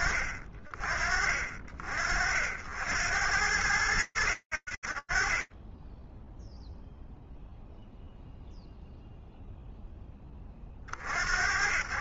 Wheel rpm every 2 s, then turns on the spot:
50, 80, 10, 0, 10, 90.
none